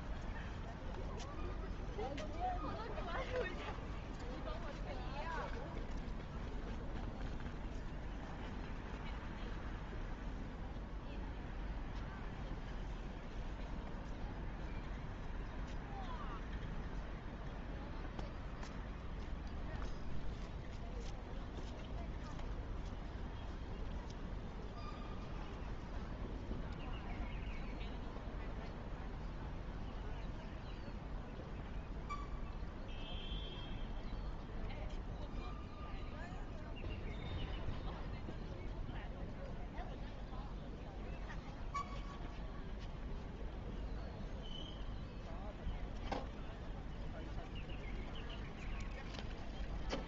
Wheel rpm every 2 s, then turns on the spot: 0, 0, 0, 0, 0, 0, 0, 0, 0, 0, 0, 0, 0, 0, 0, 0, 0, 0, 0, 0, 0, 0, 0, 0, 0.
none